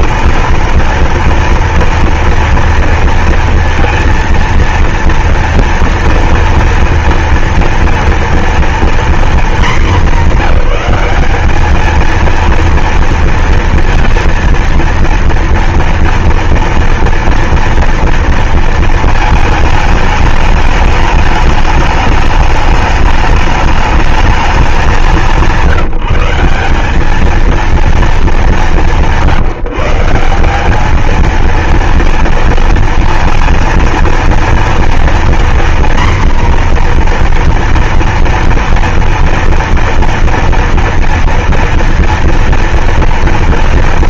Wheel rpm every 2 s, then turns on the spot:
230, 230, 230, 230, 230, 210, 220, 230, 230, 230, 210, 210, 210, 180, 220, 180, 230, 230, 250, 230, 230, 230.
none